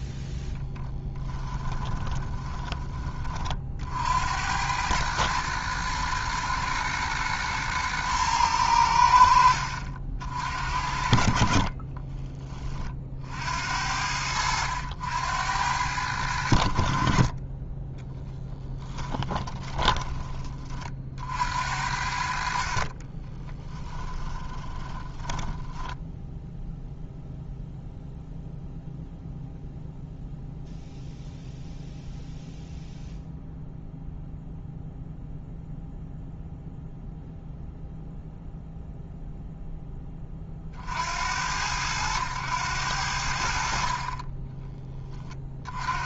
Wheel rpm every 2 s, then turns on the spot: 10, 20, 100, 110, 90, 60, 40, 80, 50, 10, 50, 30, 20, 0, 0, 0, 0, 0, 0, 0, 60, 90, 20.
0-2 18-20 22-26